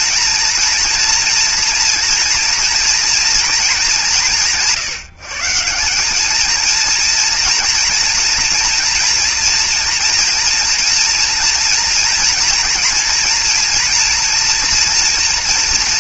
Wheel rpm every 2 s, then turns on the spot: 230, 230, 140, 230, 230, 230, 230, 230.
none